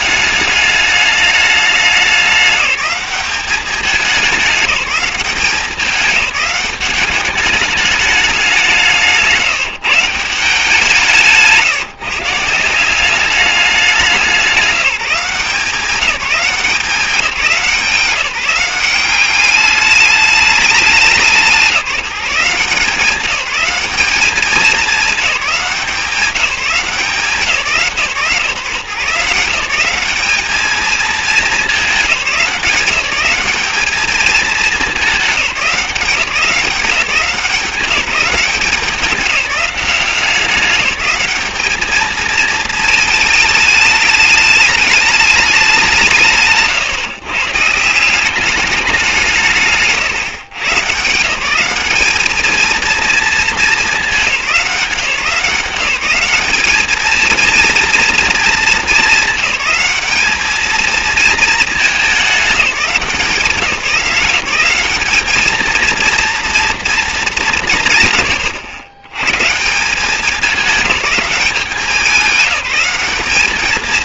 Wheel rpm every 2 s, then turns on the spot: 210, 200, 190, 200, 180, 170, 170, 190, 190, 180, 200, 170, 210, 180, 130, 210, 180, 210, 180, 190, 190, 220, 210, 150, 200, 140, 220, 190, 210, 230, 220, 200, 180, 230, 100, 210, 190.
none